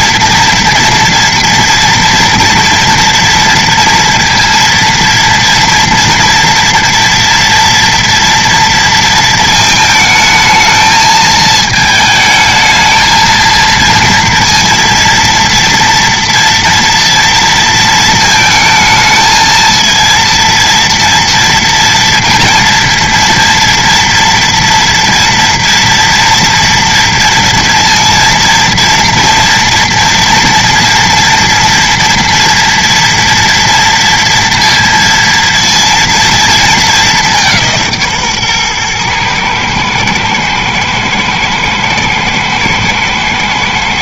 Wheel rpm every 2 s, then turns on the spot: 240, 240, 230, 230, 230, 220, 220, 230, 230, 220, 230, 230, 240, 230, 230, 230, 230, 230, 220, 140, 110, 110.
none